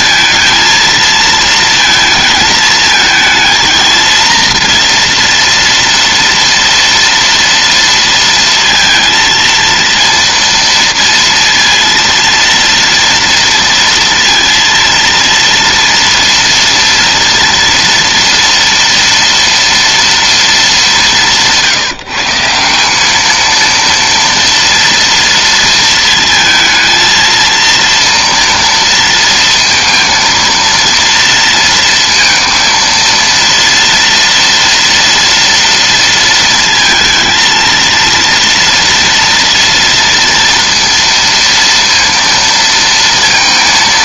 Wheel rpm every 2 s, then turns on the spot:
230, 220, 230, 230, 230, 230, 230, 230, 230, 230, 200, 170, 230, 220, 230, 230, 230, 230, 230, 230, 230, 230.
none